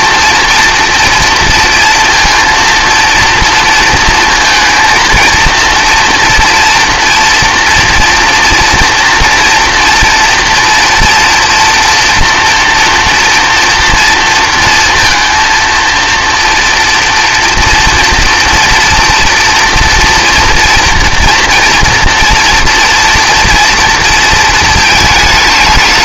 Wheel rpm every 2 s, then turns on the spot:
230, 230, 230, 230, 230, 230, 240, 230, 230, 230, 230, 240, 220.
none